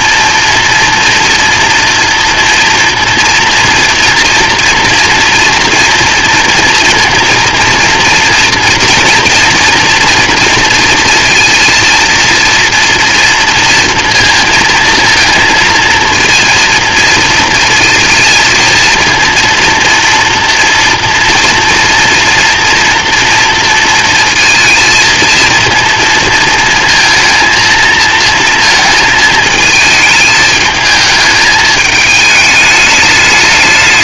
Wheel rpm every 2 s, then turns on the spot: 230, 230, 230, 230, 230, 230, 230, 230, 230, 230, 230, 230, 230, 230, 230, 220, 210.
none